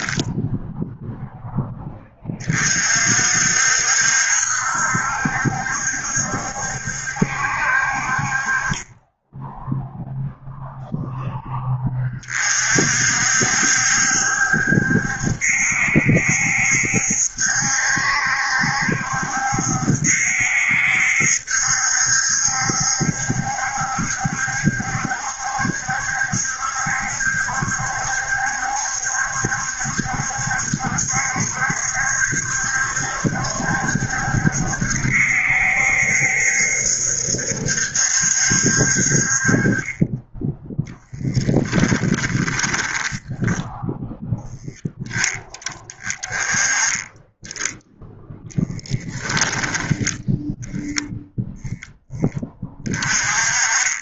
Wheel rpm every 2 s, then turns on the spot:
0, 50, 70, 70, 20, 0, 50, 70, 70, 70, 70, 70, 70, 70, 70, 70, 70, 70, 70, 50, 10, 10, 0, 10, 10, 10, 20.
40-44